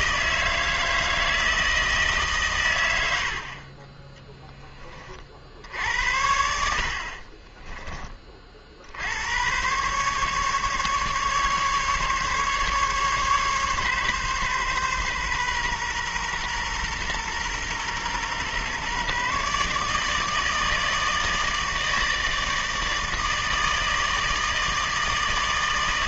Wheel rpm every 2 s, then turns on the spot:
160, 110, 10, 70, 50, 140, 140, 130, 120, 130, 160, 160, 160.
none